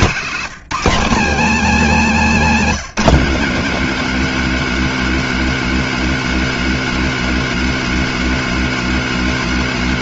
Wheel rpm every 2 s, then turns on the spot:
210, 230, 250, 250, 250.
none